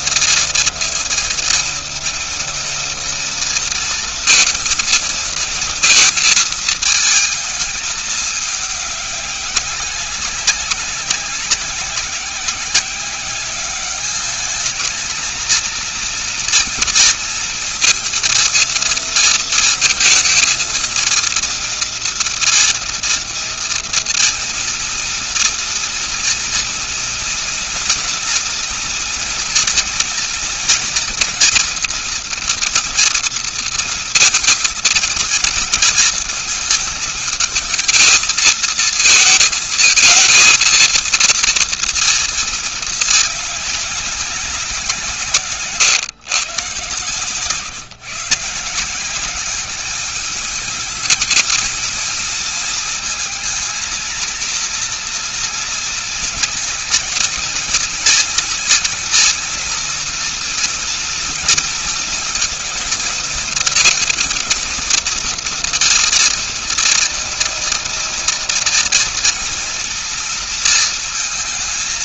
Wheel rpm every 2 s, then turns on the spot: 230, 240, 220, 220, 200, 200, 190, 230, 230, 230, 230, 230, 230, 240, 230, 230, 230, 220, 220, 220, 230, 210, 160, 140, 180, 210, 220, 230, 220, 230, 240, 230, 230, 230, 230, 230.
none